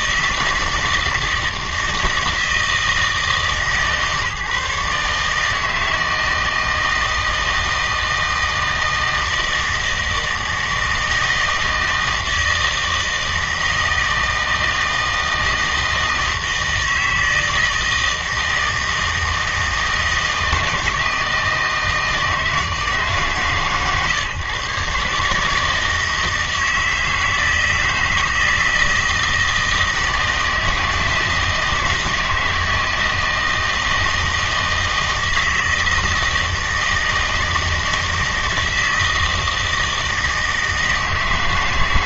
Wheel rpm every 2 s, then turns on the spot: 160, 160, 150, 160, 160, 160, 160, 160, 160, 160, 160, 150, 130, 160, 160, 160, 160, 160, 160, 160, 160.
none